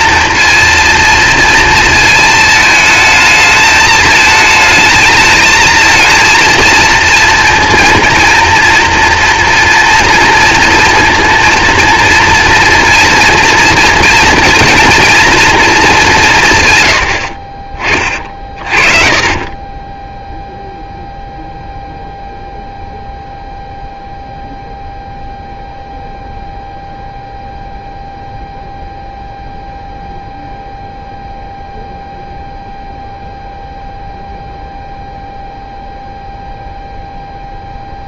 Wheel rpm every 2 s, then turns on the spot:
230, 220, 220, 230, 230, 230, 230, 240, 130, 40, 0, 0, 0, 0, 0, 0, 0, 0, 0.
none